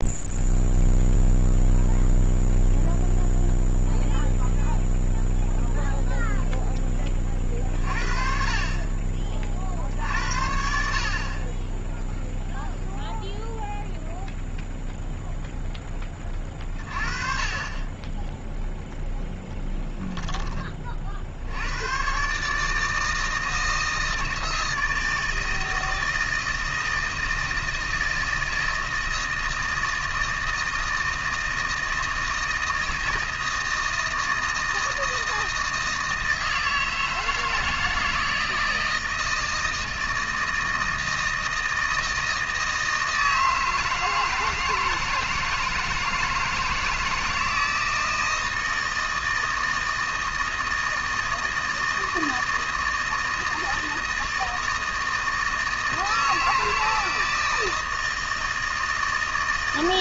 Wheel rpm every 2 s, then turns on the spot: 0, 0, 0, 0, 40, 60, 0, 0, 30, 0, 30, 150, 160, 160, 160, 160, 160, 160, 160, 160, 160, 160, 160, 160, 160, 160, 160, 160, 160, 160.
none